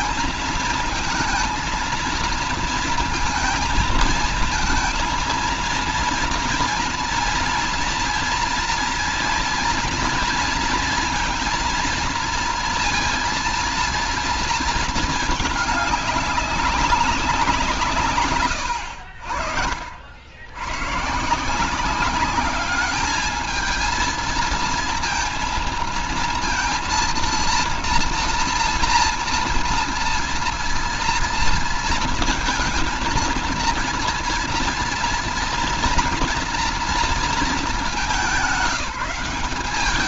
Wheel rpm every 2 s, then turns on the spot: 220, 220, 220, 230, 230, 230, 230, 230, 200, 110, 90, 200, 230, 230, 240, 240, 230, 230, 240, 210.
18-20